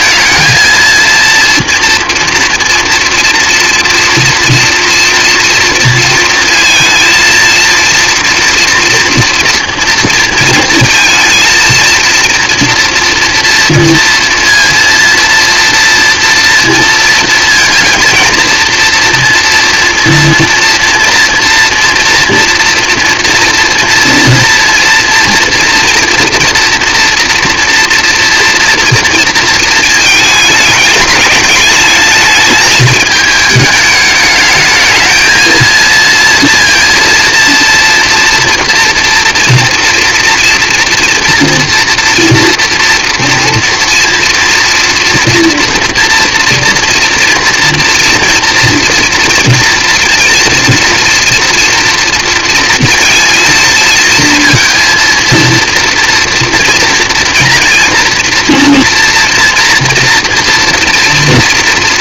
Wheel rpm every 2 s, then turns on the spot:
220, 240, 230, 220, 230, 230, 230, 230, 230, 230, 240, 230, 230, 230, 230, 220, 220, 210, 230, 230, 230, 230, 230, 230, 230, 230, 230, 230, 230, 240, 240.
none